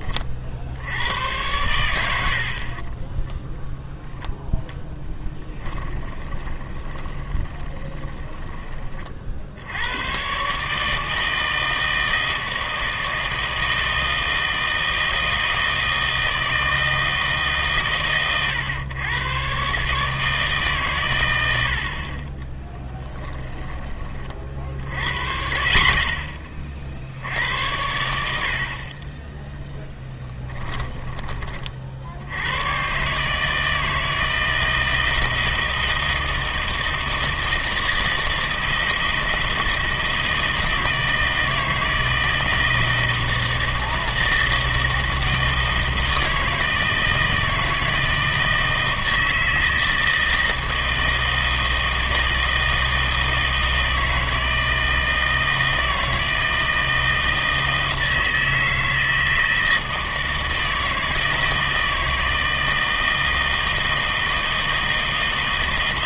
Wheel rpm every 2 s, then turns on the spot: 70, 40, 0, 20, 20, 150, 160, 160, 160, 110, 140, 10, 50, 40, 50, 20, 120, 160, 160, 160, 160, 160, 160, 160, 160, 160, 160, 160, 160, 160, 160, 160, 160.
2-4 6-8 22-24 30-32